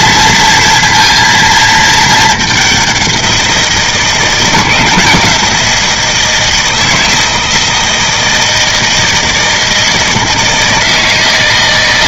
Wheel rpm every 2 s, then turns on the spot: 230, 190, 170, 160, 160, 160.
none